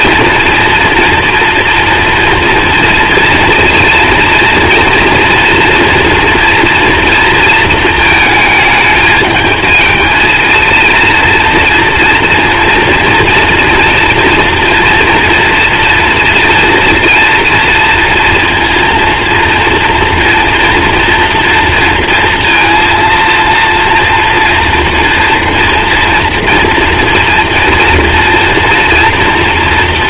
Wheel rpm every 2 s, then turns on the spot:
230, 230, 230, 240, 220, 230, 230, 230, 230, 230, 230, 230, 230, 230, 230.
none